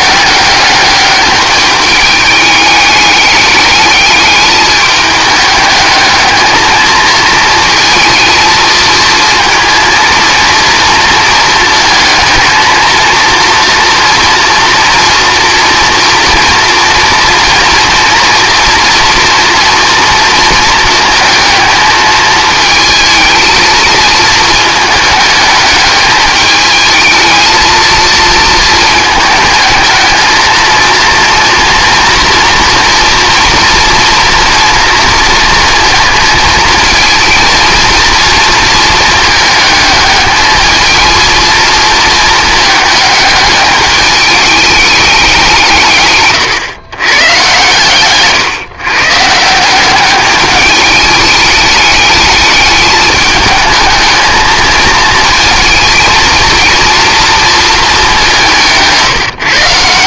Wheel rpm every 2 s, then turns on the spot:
200, 210, 210, 220, 230, 220, 230, 230, 230, 230, 220, 220, 220, 210, 220, 230, 230, 230, 220, 230, 220, 220, 210, 130, 140, 210, 210, 220, 230, 170.
none